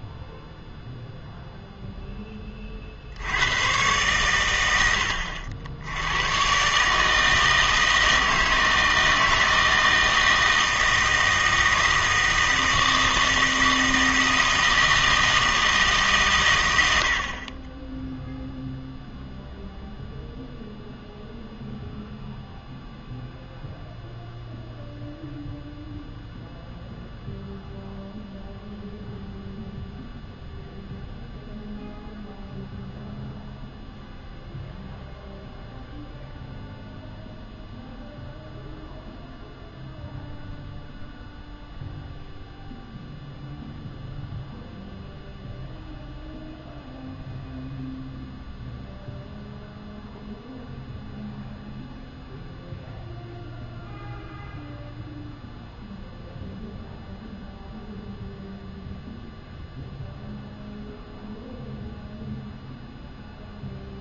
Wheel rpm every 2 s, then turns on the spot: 0, 20, 100, 130, 160, 160, 160, 160, 100, 0, 0, 0, 0, 0, 0, 0, 0, 0, 0, 0, 0, 0, 0, 0, 0, 0, 0, 0, 0, 0, 0, 0.
none